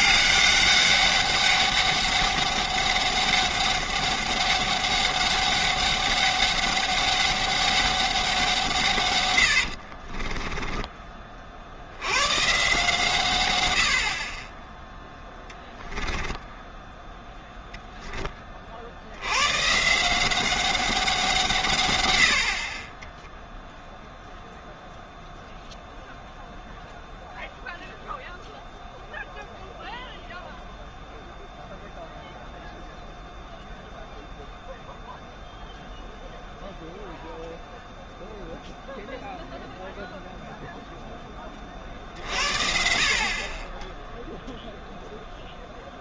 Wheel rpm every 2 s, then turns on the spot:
200, 200, 200, 200, 160, 10, 140, 10, 10, 40, 190, 40, 0, 0, 0, 0, 0, 0, 0, 0, 0, 50, 0.
10-12 16-18